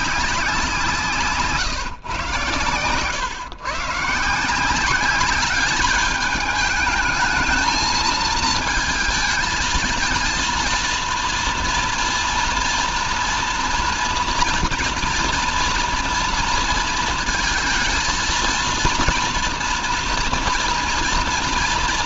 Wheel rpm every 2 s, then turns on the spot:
180, 120, 180, 210, 230, 230, 230, 230, 230, 230, 230.
none